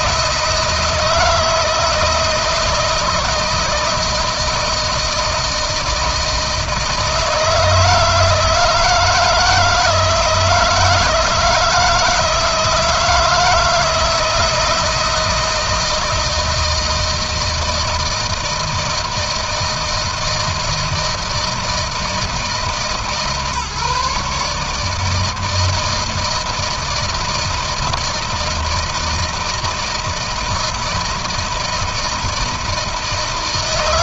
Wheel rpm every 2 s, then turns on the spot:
160, 160, 160, 160, 160, 160, 160, 160, 160, 160, 160, 160, 150, 160, 160, 160, 160.
none